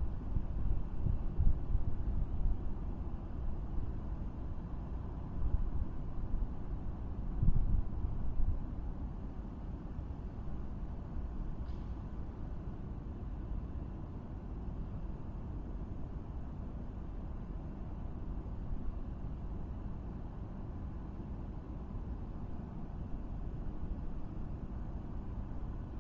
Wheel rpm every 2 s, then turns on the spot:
0, 0, 0, 0, 0, 0, 0, 0, 0, 0, 0, 0, 0.
none